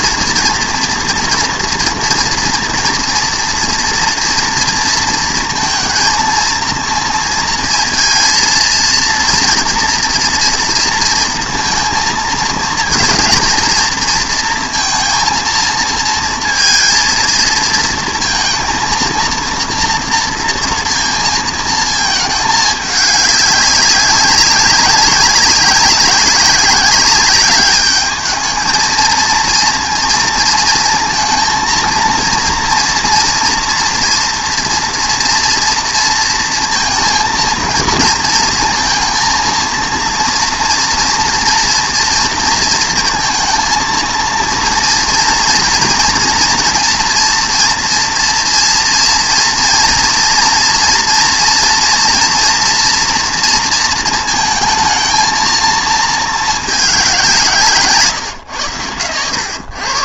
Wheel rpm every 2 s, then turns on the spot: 230, 230, 230, 230, 230, 230, 230, 230, 230, 230, 230, 210, 190, 190, 220, 230, 230, 230, 230, 230, 230, 230, 230, 230, 230, 230, 240, 220, 200, 110.
none